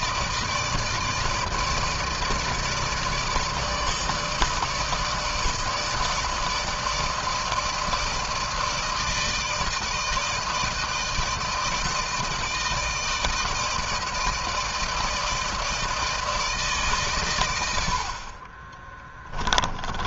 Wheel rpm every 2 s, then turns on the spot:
160, 160, 160, 160, 160, 160, 160, 160, 160, 30.
none